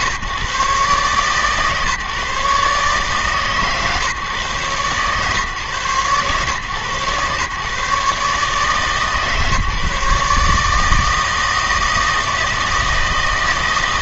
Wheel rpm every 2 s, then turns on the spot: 130, 140, 130, 120, 150, 150, 160.
none